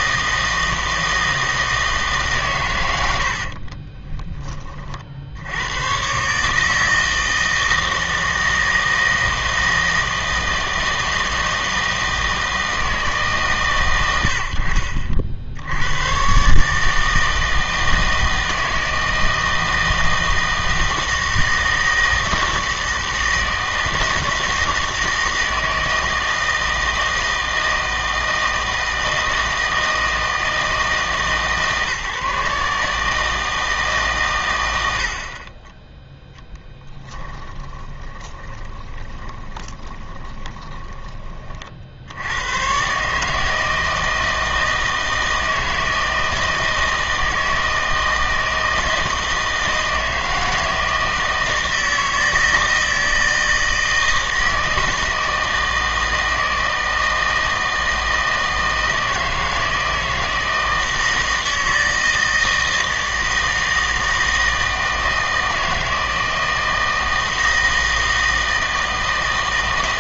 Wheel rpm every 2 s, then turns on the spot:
160, 110, 30, 150, 160, 160, 160, 60, 150, 160, 160, 160, 160, 160, 160, 160, 140, 110, 10, 20, 20, 120, 160, 160, 160, 160, 160, 160, 160, 160, 160, 160, 160, 160, 160.
36-42